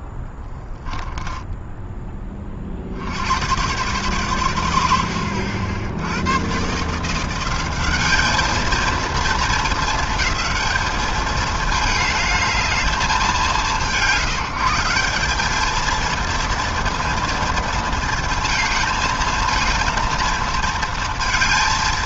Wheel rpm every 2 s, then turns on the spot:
10, 110, 60, 180, 220, 210, 170, 200, 230, 220, 230.
0-2